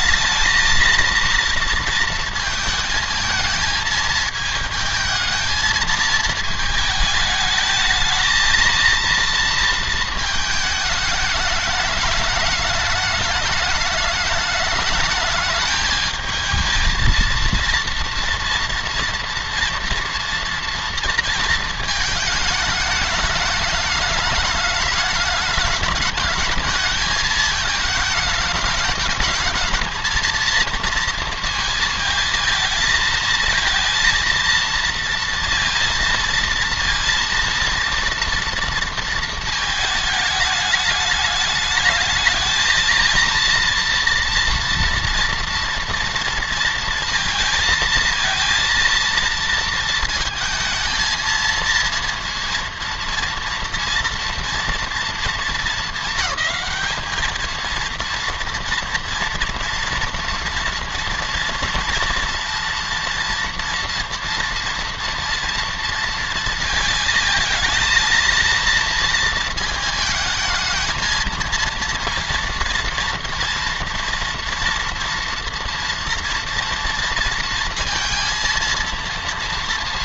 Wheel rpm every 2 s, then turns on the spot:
220, 220, 220, 220, 230, 220, 210, 210, 220, 230, 230, 210, 210, 210, 220, 230, 220, 230, 230, 230, 210, 220, 230, 230, 230, 220, 230, 230, 220, 230, 230, 230, 230, 230, 230, 230, 230, 230, 230, 230.
none